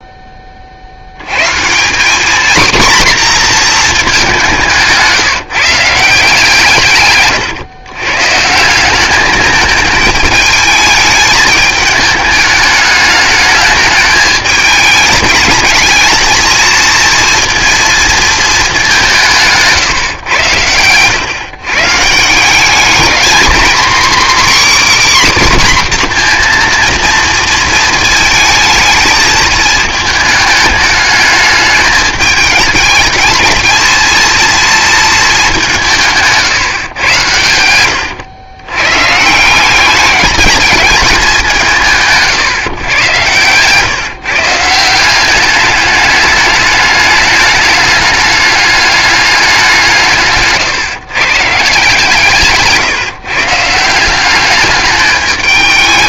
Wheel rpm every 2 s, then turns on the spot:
40, 250, 170, 140, 170, 220, 210, 220, 220, 210, 100, 190, 290, 240, 220, 210, 220, 230, 130, 110, 210, 160, 160, 210, 210, 140, 150, 200.
20-22 50-54